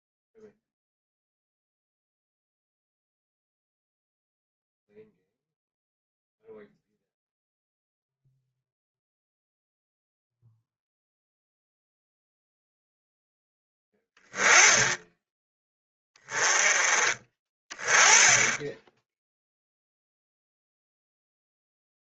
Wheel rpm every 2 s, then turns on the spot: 0, 0, 0, 0, 0, 0, 0, 10, 30, 10, 0.
none